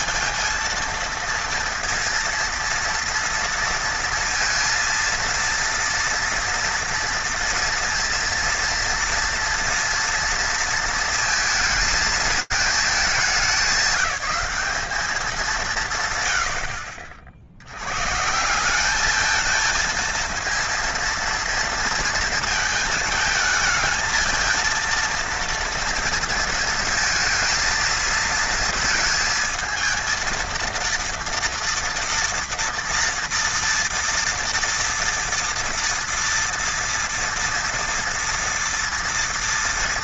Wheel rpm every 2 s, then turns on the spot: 230, 230, 230, 230, 230, 230, 220, 210, 80, 180, 230, 220, 230, 230, 230, 230, 230, 230, 230, 230.
none